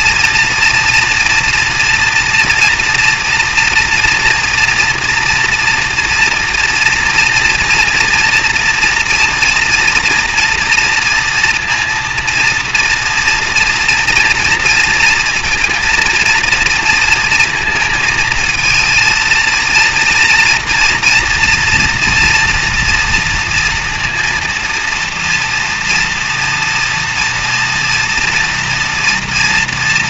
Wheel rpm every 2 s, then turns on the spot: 230, 230, 240, 230, 230, 230, 230, 230, 230, 230, 230, 230, 230, 230, 240.
none